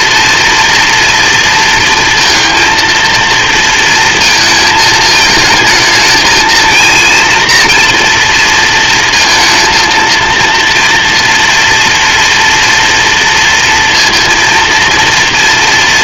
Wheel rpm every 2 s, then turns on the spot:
230, 230, 220, 230, 220, 240, 230, 230.
none